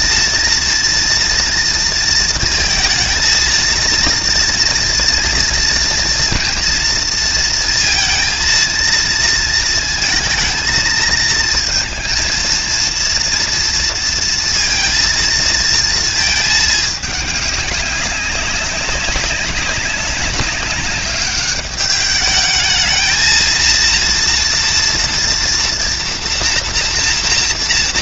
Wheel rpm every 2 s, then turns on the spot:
230, 230, 230, 230, 220, 220, 230, 230, 210, 200, 200, 220, 230, 230.
none